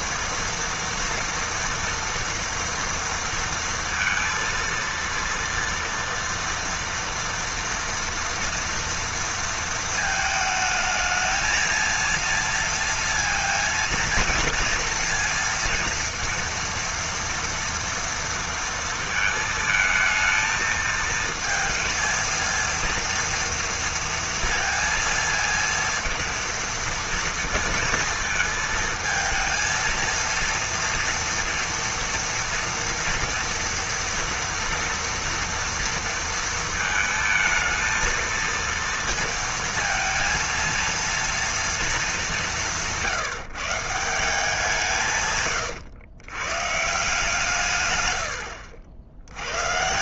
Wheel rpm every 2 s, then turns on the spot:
230, 230, 230, 230, 230, 220, 230, 230, 230, 230, 220, 230, 230, 230, 230, 230, 230, 240, 230, 230, 230, 190, 170, 130, 80.
48-50